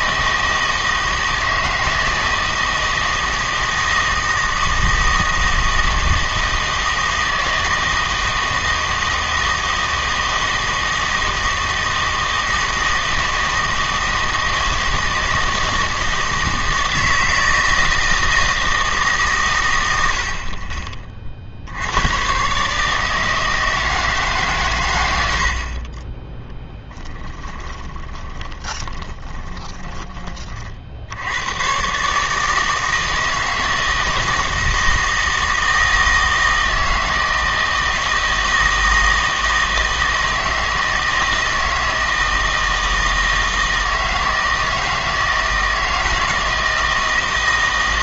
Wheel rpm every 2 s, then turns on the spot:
160, 160, 160, 160, 160, 160, 160, 160, 160, 160, 30, 150, 110, 10, 20, 70, 160, 160, 160, 160, 160, 160, 160, 160.
26-30